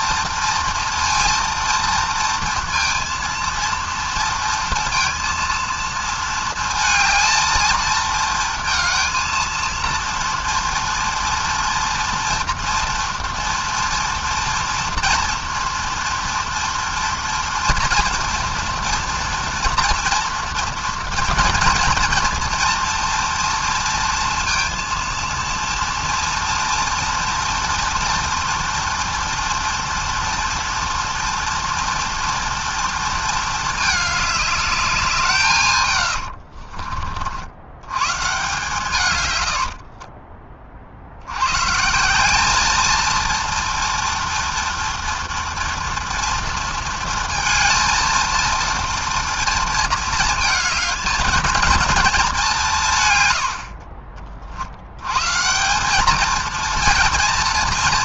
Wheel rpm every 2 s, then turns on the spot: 230, 230, 230, 220, 230, 230, 240, 240, 230, 230, 230, 230, 230, 230, 230, 230, 230, 210, 60, 140, 30, 200, 230, 230, 230, 220, 190, 60, 220.
36-38